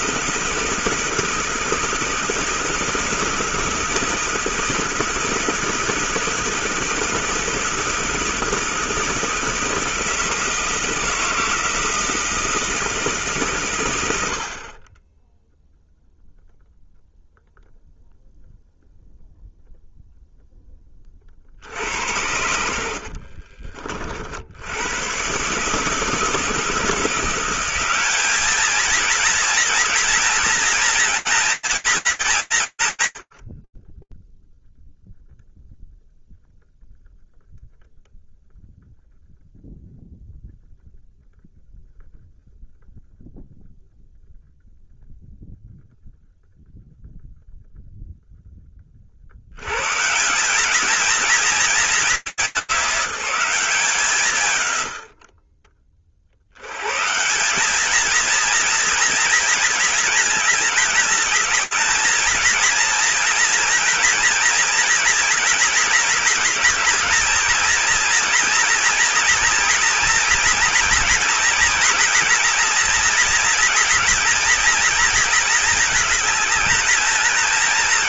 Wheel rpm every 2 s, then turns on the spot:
160, 160, 160, 160, 160, 160, 160, 50, 0, 0, 10, 70, 80, 160, 220, 230, 160, 0, 0, 0, 0, 0, 0, 0, 90, 230, 200, 60, 170, 230, 210, 230, 230, 230, 230, 240, 240, 230, 220.
22-24